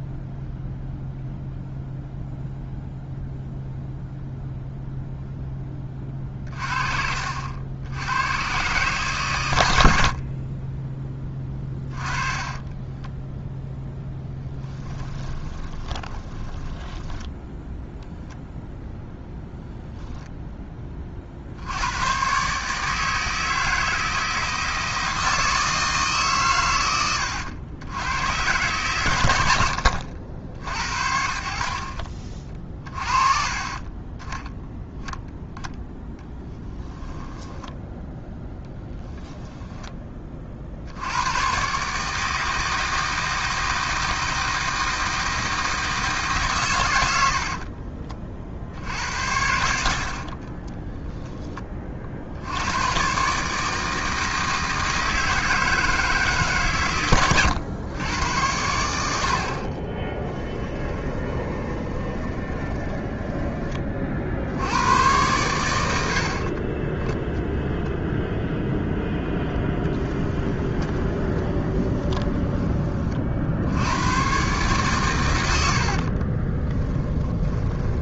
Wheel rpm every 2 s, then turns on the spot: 0, 0, 0, 40, 120, 20, 20, 10, 10, 0, 20, 150, 160, 110, 120, 70, 30, 0, 10, 0, 80, 160, 160, 110, 60, 20, 110, 160, 120, 80, 20, 10, 90, 20, 0, 20, 30, 130, 20.
12-16 36-38 50-52 60-64 70-72 76-78